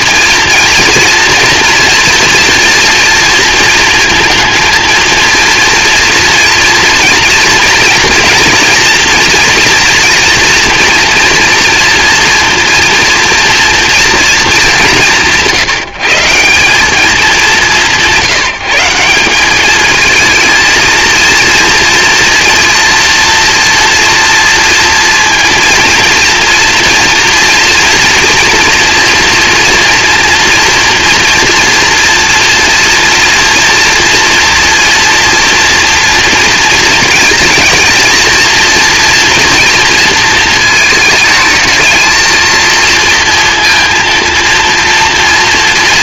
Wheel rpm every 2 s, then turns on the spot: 230, 240, 230, 230, 230, 240, 230, 190, 190, 170, 230, 230, 230, 230, 230, 230, 230, 230, 230, 240, 220, 230, 230.
none